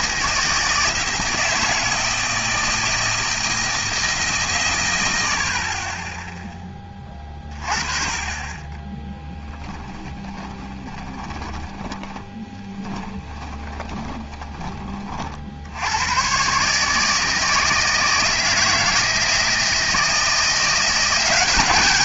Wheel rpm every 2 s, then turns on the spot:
160, 160, 100, 10, 20, 20, 20, 30, 140, 160, 170.
8-14